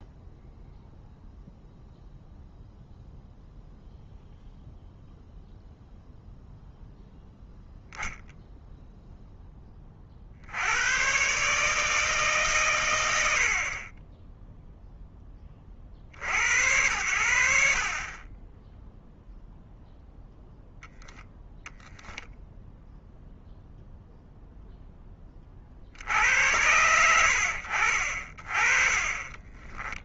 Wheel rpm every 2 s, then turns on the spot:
0, 0, 0, 0, 0, 110, 100, 10, 80, 10, 0, 0, 10, 90, 30.
28-30